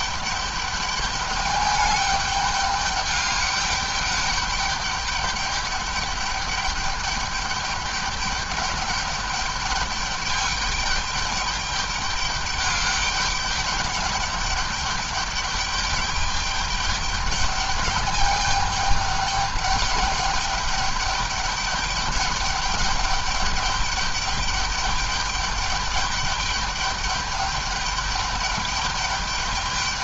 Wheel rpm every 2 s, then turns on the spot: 210, 210, 200, 210, 210, 200, 200, 210, 210, 200, 200, 210, 210, 210, 210.
none